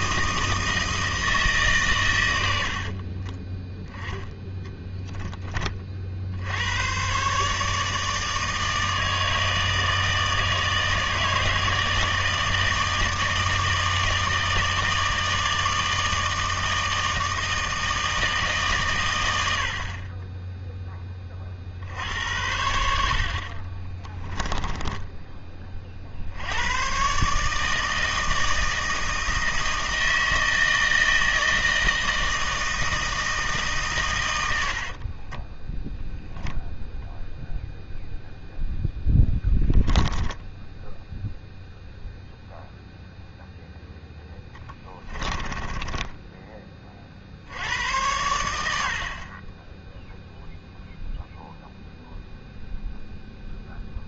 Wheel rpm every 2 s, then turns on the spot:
160, 70, 10, 100, 160, 160, 160, 160, 160, 140, 20, 80, 20, 100, 160, 160, 160, 70, 0, 0, 0, 0, 10, 20, 80, 0, 0.
2-4 24-26 34-36 44-46